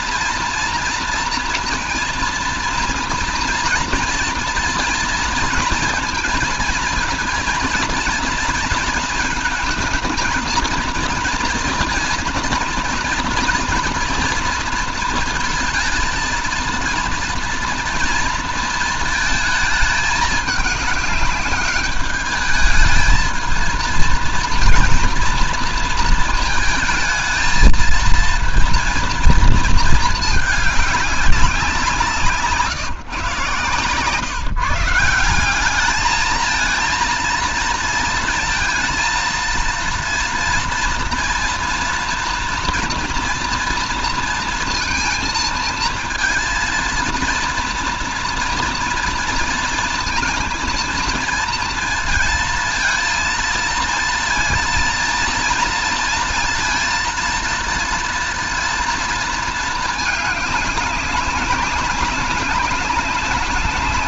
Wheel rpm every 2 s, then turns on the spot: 240, 230, 230, 230, 230, 230, 230, 230, 230, 230, 210, 210, 230, 230, 230, 210, 150, 150, 220, 230, 230, 240, 230, 230, 230, 230, 230, 230, 230, 230, 210, 200.
none